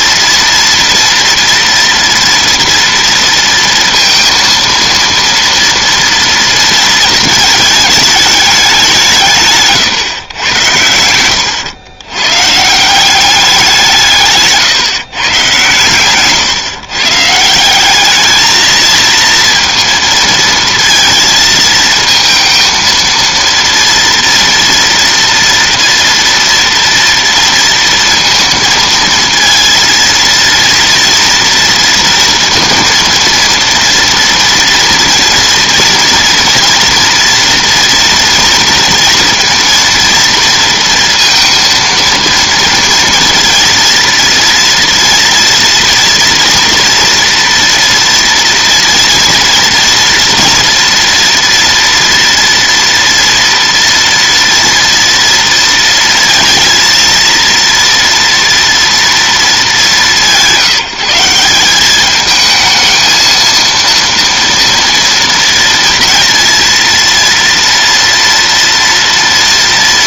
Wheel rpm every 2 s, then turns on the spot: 230, 230, 230, 230, 200, 100, 150, 150, 130, 220, 230, 230, 230, 230, 230, 230, 230, 230, 230, 240, 230, 230, 230, 230, 240, 230, 230, 230, 230, 230, 180, 220, 230, 230, 230.
none